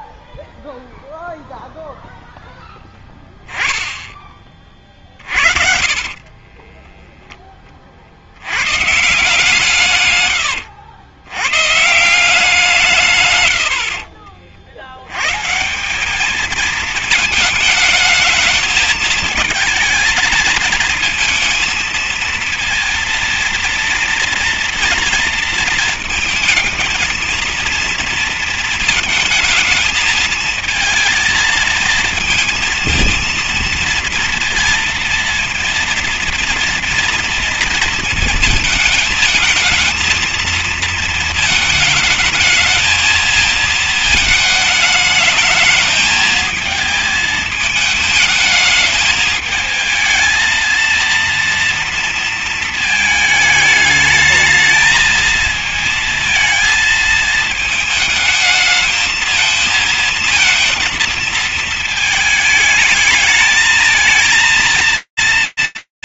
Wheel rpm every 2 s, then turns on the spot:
0, 0, 20, 20, 90, 110, 170, 70, 210, 220, 220, 230, 230, 230, 220, 220, 230, 230, 230, 230, 230, 220, 220, 220, 220, 230, 230, 210, 220, 220, 230, 220, 230.
6-8